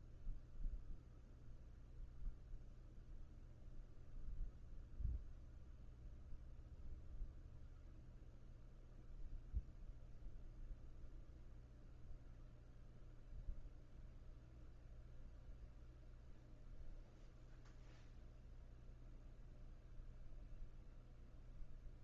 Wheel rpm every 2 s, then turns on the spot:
0, 0, 0, 0, 0, 0, 0, 0, 0, 0, 0.
none